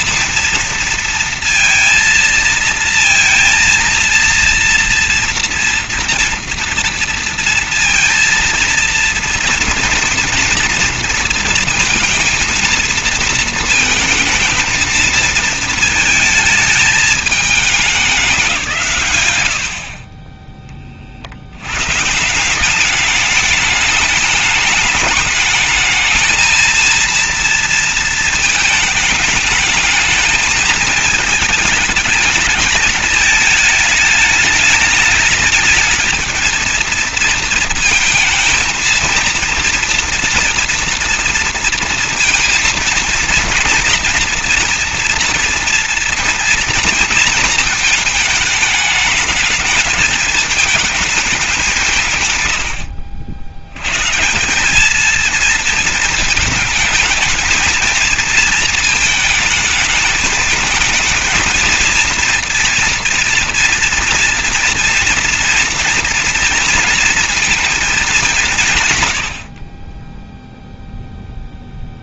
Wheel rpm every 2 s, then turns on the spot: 230, 230, 230, 230, 230, 230, 230, 220, 220, 150, 30, 200, 210, 230, 220, 220, 220, 210, 220, 230, 230, 230, 230, 230, 220, 210, 80, 200, 220, 220, 220, 240, 230, 230, 140, 0.
none